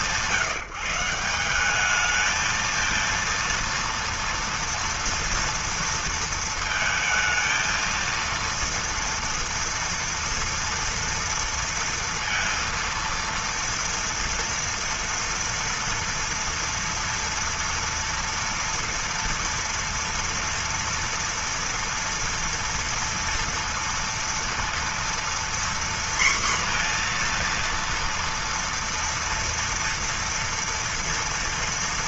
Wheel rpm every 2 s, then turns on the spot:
160, 230, 230, 230, 230, 230, 230, 230, 230, 230, 230, 230, 230, 240, 230, 240.
none